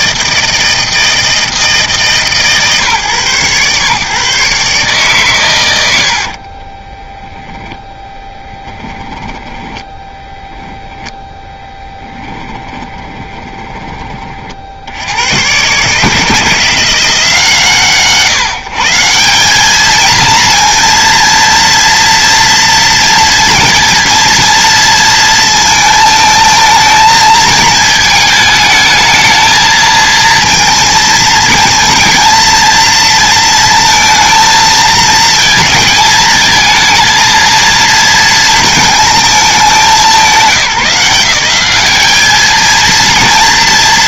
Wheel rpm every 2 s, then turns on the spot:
160, 140, 140, 30, 10, 10, 20, 60, 170, 160, 230, 230, 230, 220, 220, 230, 230, 230, 230, 230, 190, 220.
6-10 12-14